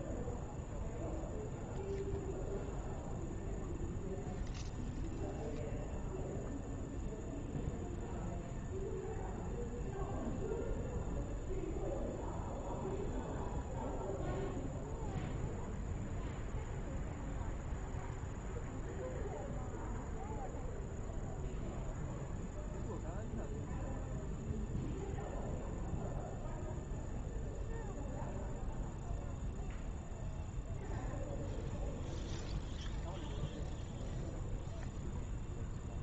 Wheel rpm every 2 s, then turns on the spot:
0, 0, 0, 0, 0, 0, 0, 0, 0, 0, 0, 0, 0, 0, 0, 0, 0, 0.
none